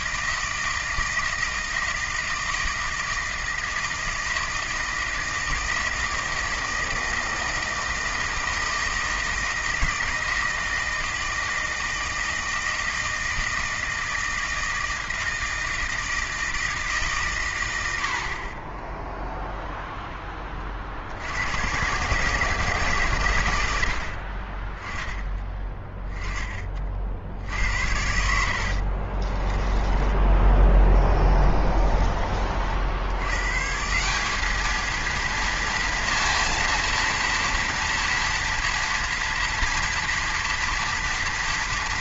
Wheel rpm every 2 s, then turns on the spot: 160, 160, 160, 160, 160, 160, 160, 160, 160, 20, 50, 150, 20, 30, 60, 10, 50, 210, 230, 240, 230.
28-30